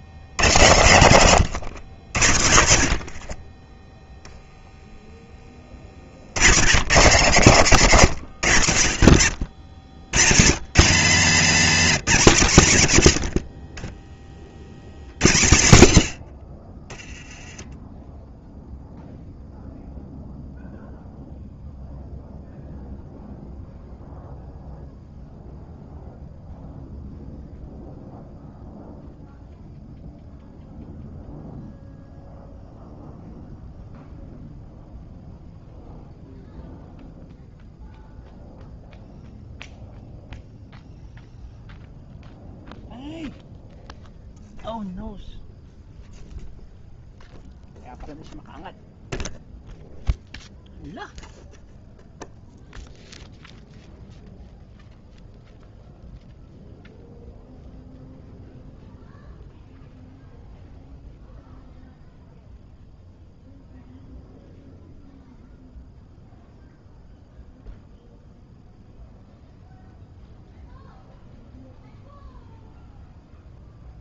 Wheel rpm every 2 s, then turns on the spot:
100, 70, 0, 80, 100, 140, 190, 50, 60, 0, 0, 0, 0, 0, 0, 0, 0, 0, 0, 0, 0, 0, 0, 0, 0, 0, 0, 0, 0, 0, 0, 0, 0, 0, 0, 0, 0.
none